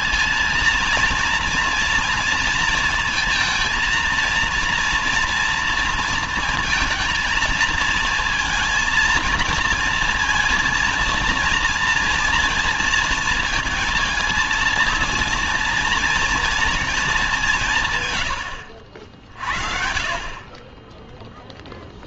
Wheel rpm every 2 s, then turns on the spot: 210, 230, 230, 230, 230, 230, 230, 230, 230, 80, 30.
none